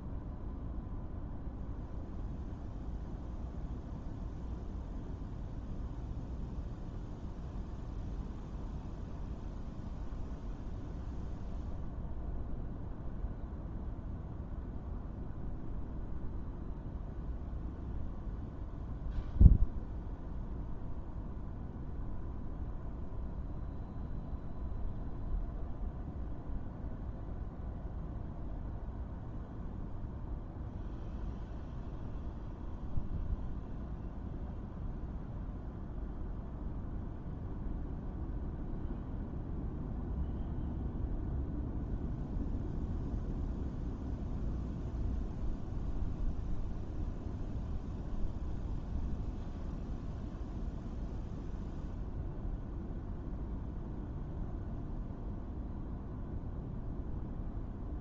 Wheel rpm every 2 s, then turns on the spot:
0, 0, 0, 0, 0, 0, 0, 0, 0, 0, 0, 0, 0, 0, 0, 0, 0, 0, 0, 0, 0, 0, 0, 0, 0, 0, 0, 0, 0.
none